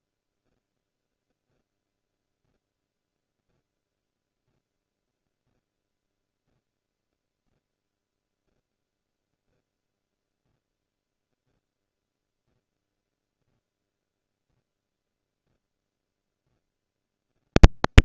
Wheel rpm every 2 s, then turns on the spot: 0, 0, 0, 0, 0, 0, 0, 0, 10.
none